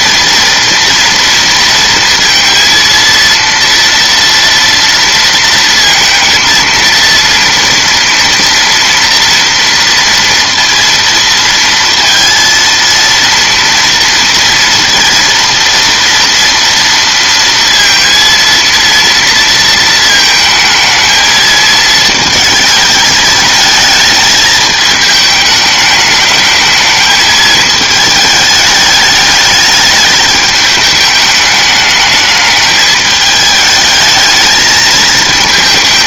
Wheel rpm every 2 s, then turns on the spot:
230, 230, 230, 230, 230, 230, 230, 230, 230, 230, 220, 220, 210, 220, 210, 210, 210, 220.
none